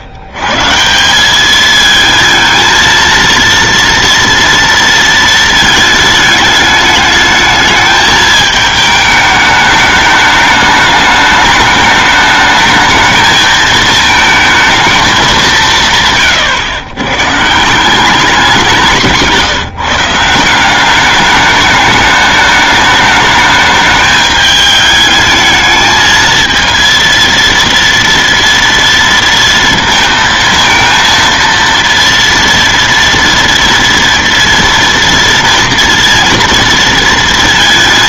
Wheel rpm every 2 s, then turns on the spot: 130, 220, 230, 210, 220, 210, 210, 220, 130, 180, 180, 210, 210, 230, 230, 230, 230, 230, 230.
none